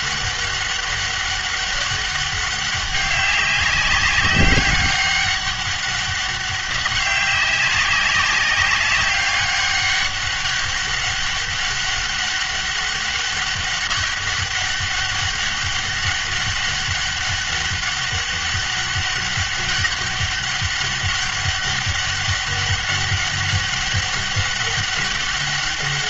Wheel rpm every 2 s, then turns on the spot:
200, 200, 200, 200, 190, 200, 200, 200, 200, 200, 200, 200, 200.
none